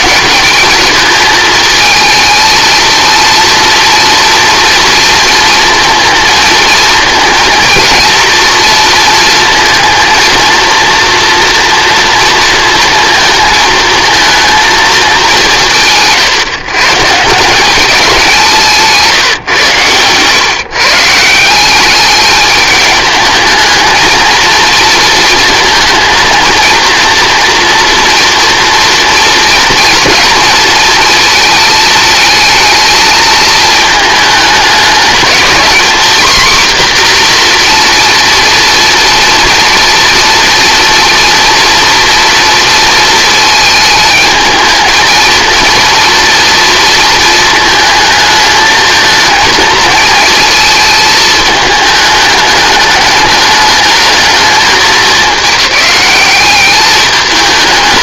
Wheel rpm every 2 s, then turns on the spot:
200, 230, 230, 230, 230, 230, 230, 220, 140, 160, 140, 210, 230, 230, 230, 230, 220, 220, 250, 240, 230, 230, 220, 230, 220, 220, 210, 210, 200.
none